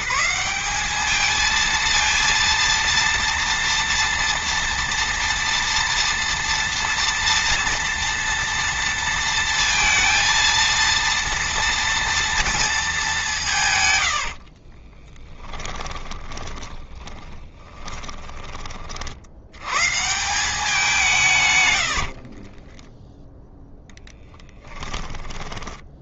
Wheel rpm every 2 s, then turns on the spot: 220, 230, 230, 230, 230, 230, 200, 20, 10, 50, 160, 10, 10.
14-18 22-26